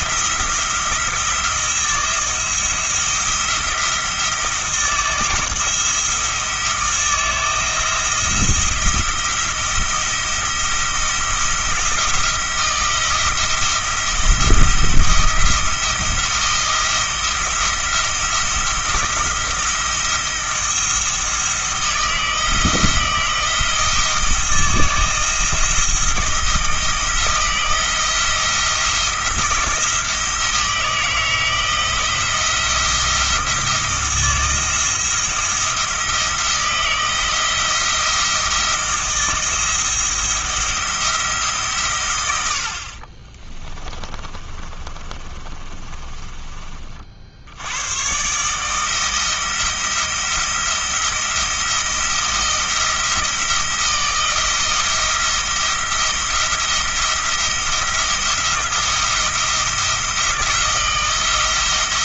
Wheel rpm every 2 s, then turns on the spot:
170, 170, 160, 160, 160, 160, 170, 170, 170, 170, 160, 170, 160, 160, 170, 160, 170, 170, 170, 160, 170, 60, 30, 40, 160, 170, 170, 170, 170, 170, 170.
44-46